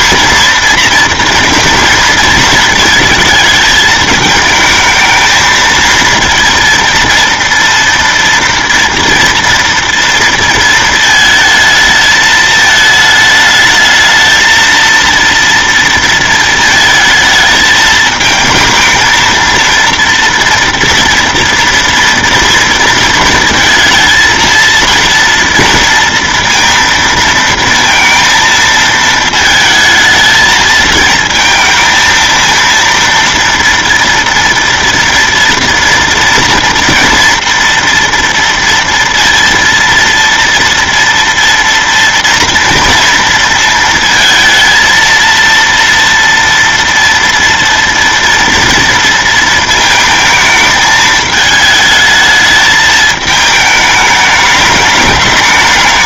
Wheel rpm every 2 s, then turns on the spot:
230, 220, 220, 230, 230, 230, 220, 220, 220, 220, 230, 230, 230, 230, 220, 220, 230, 230, 230, 230, 230, 230, 220, 230, 230, 220, 220, 210.
none